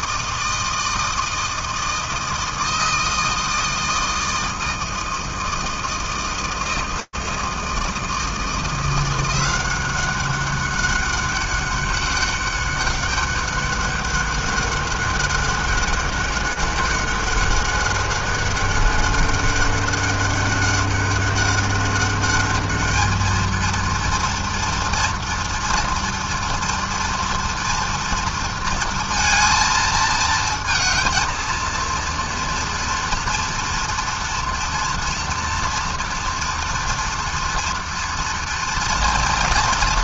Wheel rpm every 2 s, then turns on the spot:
160, 160, 160, 160, 170, 190, 200, 200, 200, 200, 200, 210, 230, 230, 230, 230, 230, 230, 230, 240.
none